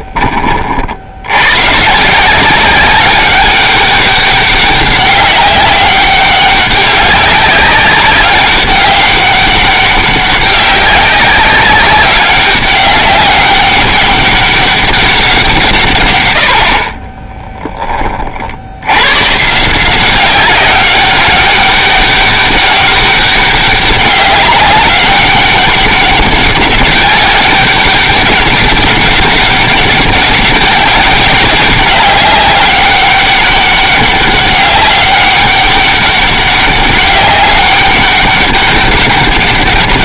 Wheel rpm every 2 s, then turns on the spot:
60, 190, 190, 200, 200, 200, 200, 200, 40, 80, 200, 200, 200, 200, 200, 200, 200, 200, 200, 200.
none